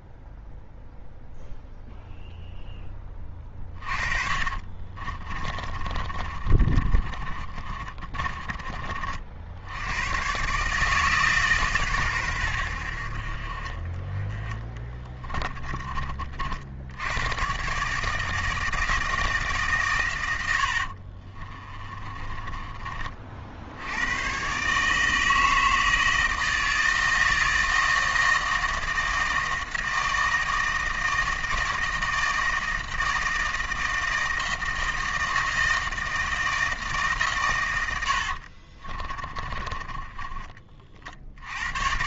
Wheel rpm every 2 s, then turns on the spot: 0, 10, 30, 30, 30, 140, 90, 20, 60, 160, 70, 30, 130, 160, 160, 160, 160, 160, 160, 60, 40.
4-8 14-16 20-22 38-40